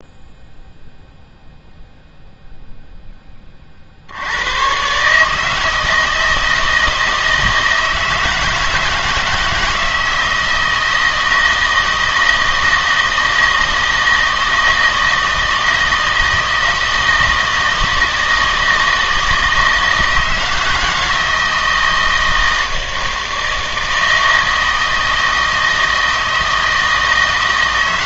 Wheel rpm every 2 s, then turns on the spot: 0, 0, 120, 160, 160, 160, 160, 160, 160, 160, 160, 160, 160, 160.
none